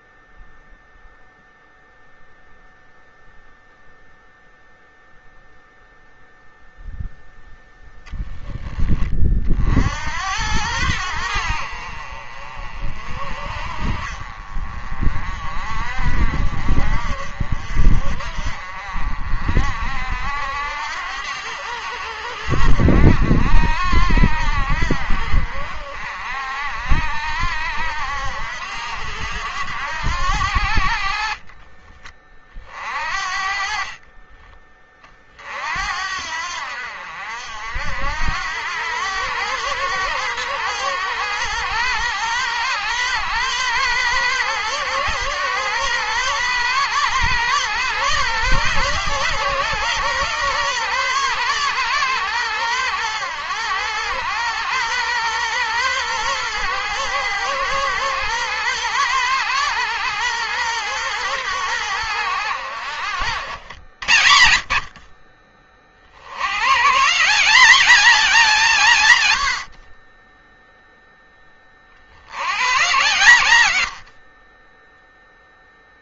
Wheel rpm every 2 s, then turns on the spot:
0, 0, 0, 0, 30, 80, 50, 40, 50, 50, 80, 70, 70, 60, 80, 60, 40, 40, 70, 100, 120, 120, 130, 120, 130, 130, 110, 120, 120, 120, 120, 90, 50, 140, 160, 0, 100, 10.
74-76